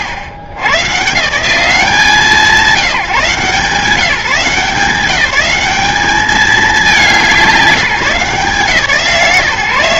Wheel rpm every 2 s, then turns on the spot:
110, 180, 190, 200, 140.
none